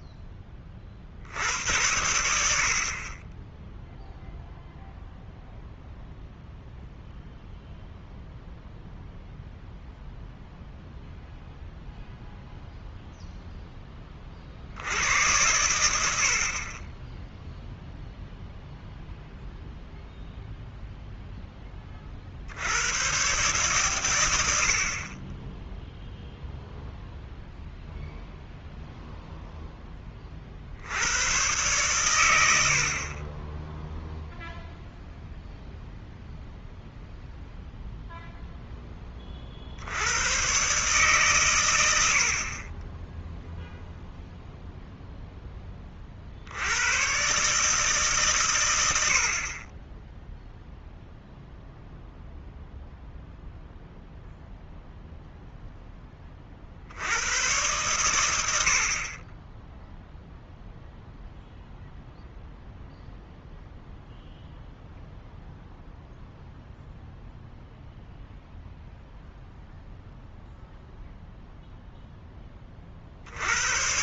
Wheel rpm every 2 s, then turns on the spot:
40, 50, 0, 0, 0, 0, 0, 70, 20, 0, 0, 100, 60, 0, 0, 70, 60, 0, 0, 10, 140, 20, 0, 90, 90, 0, 0, 0, 60, 60, 0, 0, 0, 0, 0, 0, 30.
none